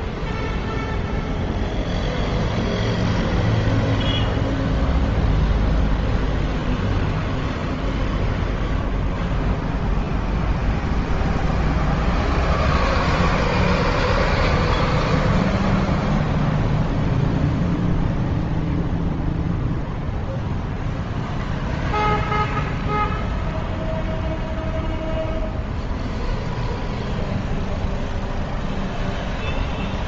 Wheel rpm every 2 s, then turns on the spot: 0, 0, 0, 0, 0, 0, 0, 0, 0, 0, 0, 0, 0, 0, 0.
none